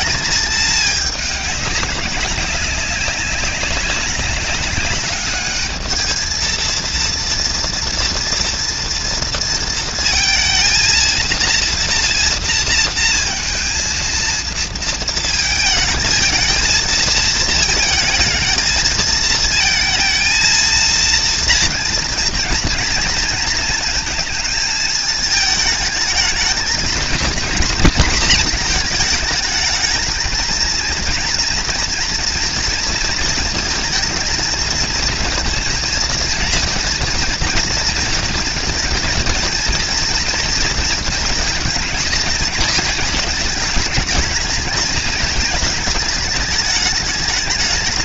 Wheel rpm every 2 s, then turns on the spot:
210, 200, 210, 230, 230, 230, 230, 230, 220, 230, 230, 230, 220, 230, 230, 230, 230, 230, 230, 230, 230, 210, 220, 210.
none